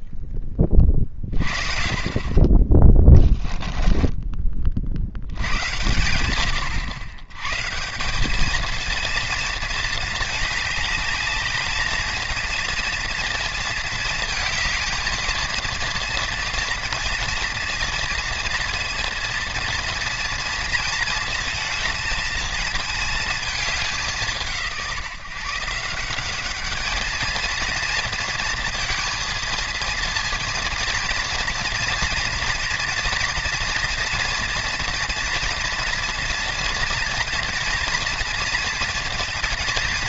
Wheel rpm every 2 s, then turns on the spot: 20, 20, 50, 100, 230, 210, 230, 230, 230, 230, 230, 220, 160, 210, 230, 230, 240, 240, 230, 230.
none